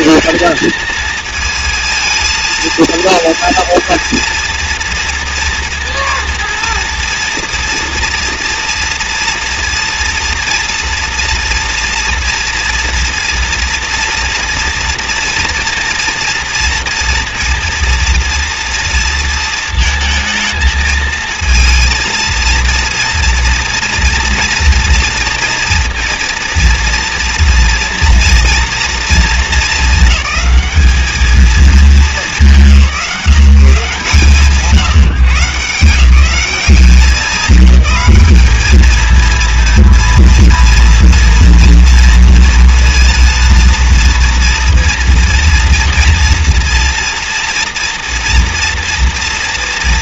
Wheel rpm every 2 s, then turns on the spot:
230, 230, 230, 230, 230, 240, 230, 240, 230, 230, 220, 230, 230, 230, 230, 210, 170, 160, 200, 220, 230, 230, 240, 230, 230.
none